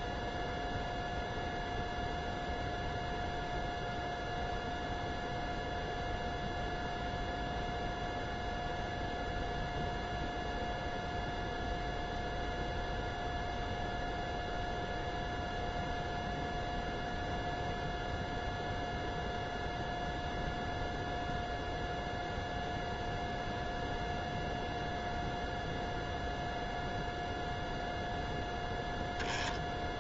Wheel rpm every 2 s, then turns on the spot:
0, 0, 0, 0, 0, 0, 0, 0, 0, 0, 0, 0, 0, 0, 0.
none